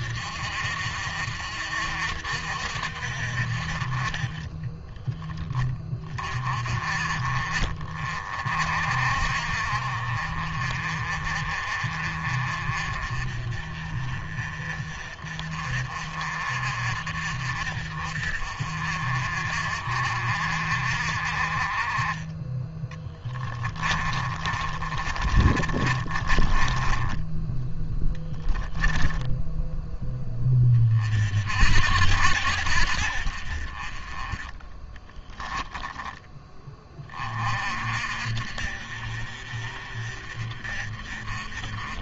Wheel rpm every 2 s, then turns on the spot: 50, 60, 20, 40, 50, 40, 40, 40, 50, 50, 50, 20, 30, 20, 0, 30, 70, 20, 20, 50, 40.
22-28 34-36